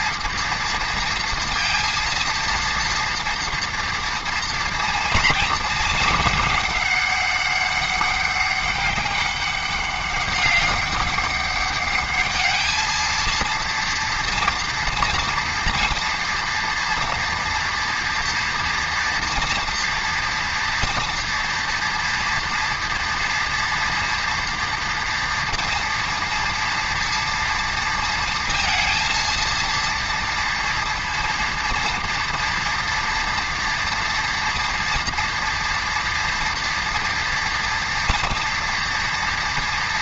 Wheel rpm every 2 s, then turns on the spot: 230, 230, 230, 210, 200, 200, 220, 230, 230, 230, 230, 230, 240, 230, 230, 230, 230, 230, 230, 230.
none